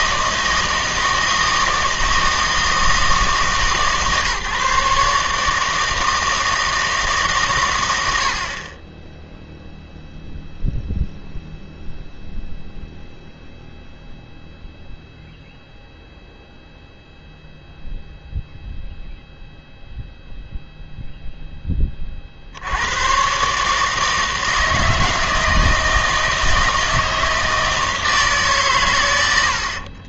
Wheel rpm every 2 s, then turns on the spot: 160, 160, 150, 160, 40, 0, 0, 0, 0, 0, 0, 80, 160, 160, 140.
none